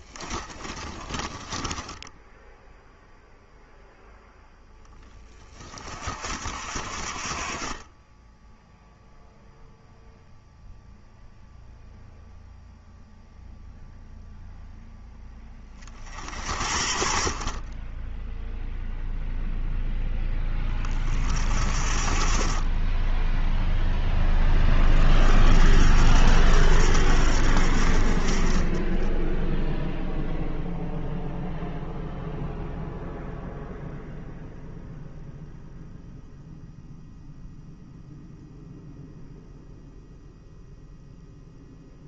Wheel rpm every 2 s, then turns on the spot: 20, 0, 10, 50, 0, 0, 0, 0, 50, 0, 40, 20, 30, 60, 20, 0, 0, 0, 0, 0, 0.
0-2